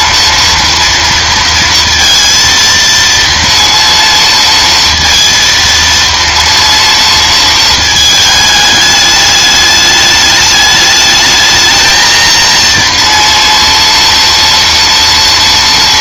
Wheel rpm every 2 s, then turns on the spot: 230, 230, 230, 230, 210, 210, 230, 230.
none